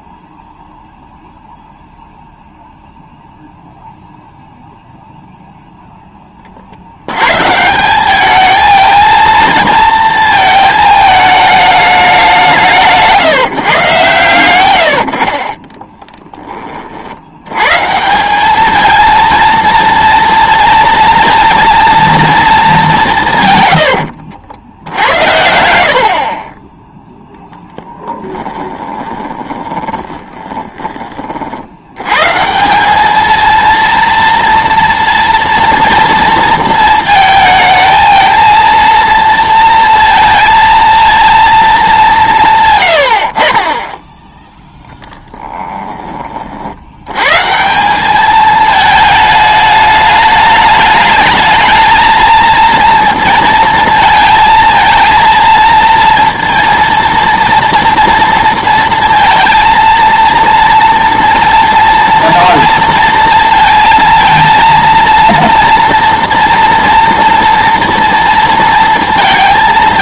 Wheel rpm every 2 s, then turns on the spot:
0, 0, 0, 50, 220, 220, 160, 100, 30, 210, 230, 210, 70, 20, 10, 20, 180, 230, 230, 230, 230, 130, 10, 40, 220, 210, 230, 220, 230, 230, 230, 230, 230, 230, 230.
28-30 44-46